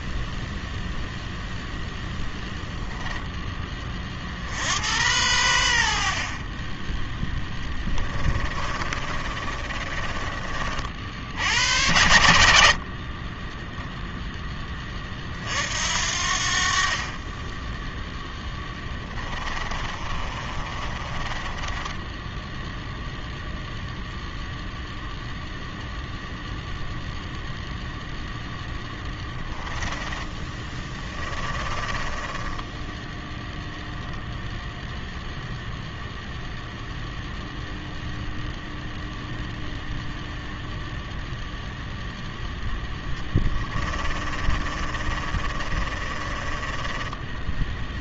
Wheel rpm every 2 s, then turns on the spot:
0, 0, 80, 20, 30, 40, 50, 20, 50, 20, 30, 0, 0, 0, 10, 20, 10, 0, 0, 0, 0, 0, 30, 20.
8-10 18-22 30-34 44-48